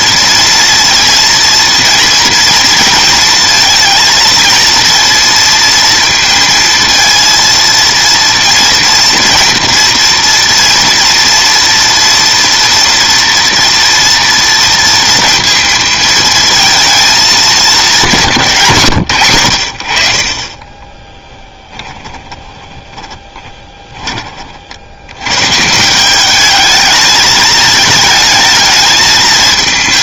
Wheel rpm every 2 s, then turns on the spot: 230, 230, 230, 230, 230, 230, 240, 230, 230, 160, 20, 20, 50, 210, 220.
22-24